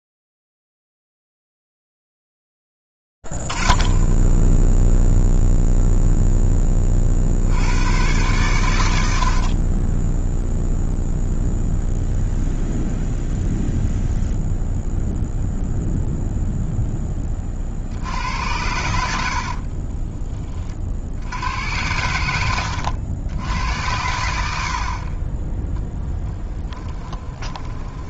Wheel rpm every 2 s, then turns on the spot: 0, 0, 10, 0, 100, 20, 0, 0, 0, 80, 30, 100, 70, 10.
20-24 26-28